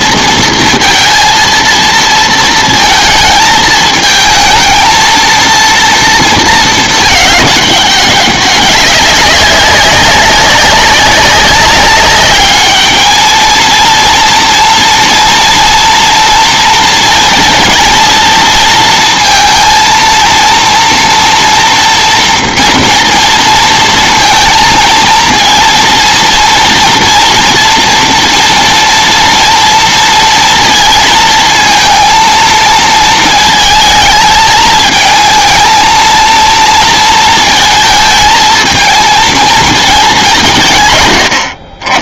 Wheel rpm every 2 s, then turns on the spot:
230, 230, 230, 220, 190, 200, 210, 230, 230, 230, 230, 230, 230, 230, 230, 230, 230, 220, 230, 220, 130.
none